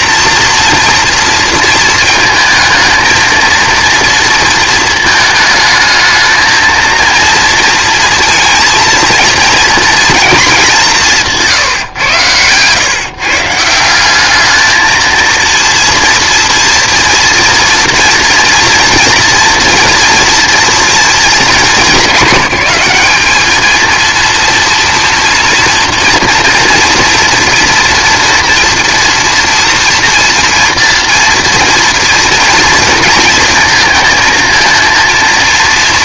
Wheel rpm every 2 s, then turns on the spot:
240, 230, 230, 230, 230, 200, 130, 220, 230, 230, 240, 200, 230, 240, 230, 240, 230, 230.
none